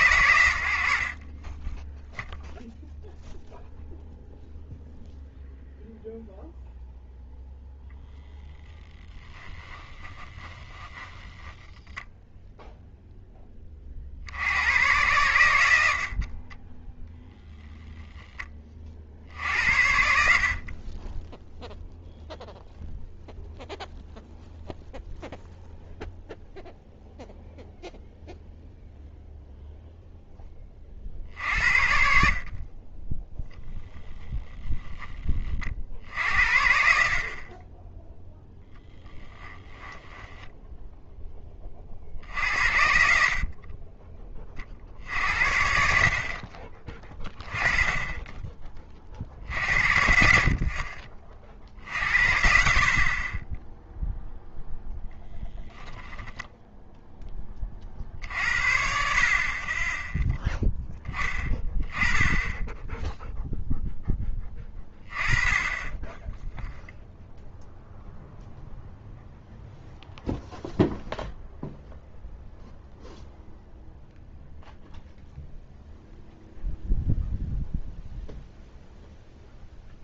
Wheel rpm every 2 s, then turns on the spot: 80, 0, 0, 0, 20, 10, 0, 90, 30, 30, 40, 0, 0, 0, 0, 30, 30, 20, 60, 10, 0, 70, 40, 30, 30, 60, 60, 0, 0, 50, 10, 10, 20, 0, 0, 0, 0, 0, 0, 0.
8-12 16-18 38-40